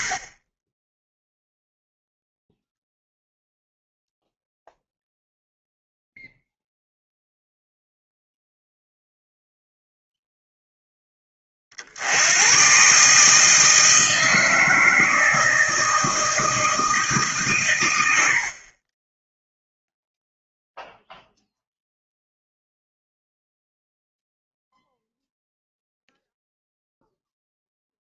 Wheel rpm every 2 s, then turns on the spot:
20, 0, 0, 0, 0, 0, 120, 160, 160, 40, 0, 0, 0, 0.
none